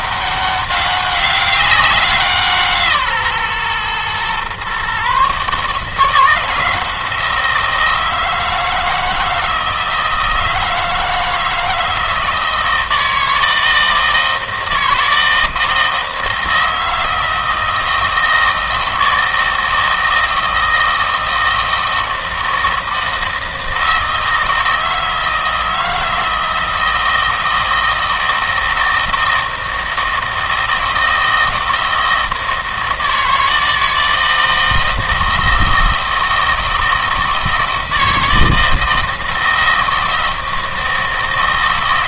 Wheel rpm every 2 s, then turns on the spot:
200, 160, 130, 170, 160, 160, 160, 160, 160, 160, 160, 160, 160, 160, 160, 160, 160, 160, 160, 160, 160.
none